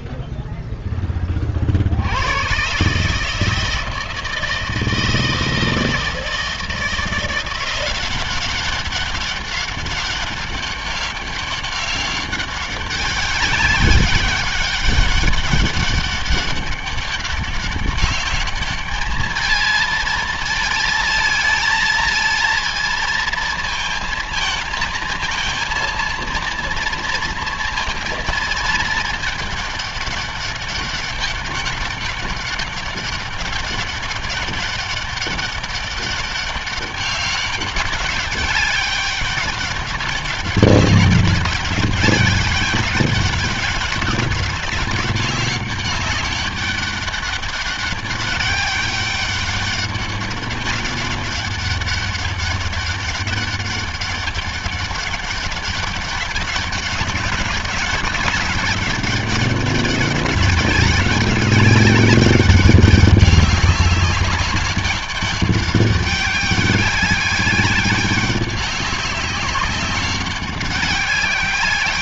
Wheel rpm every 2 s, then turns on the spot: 10, 140, 160, 170, 190, 200, 200, 200, 200, 210, 220, 230, 220, 230, 220, 200, 200, 200, 200, 200, 200, 200, 190, 200, 200, 200, 200, 200, 200, 200, 190, 200, 200, 200, 190, 190.
none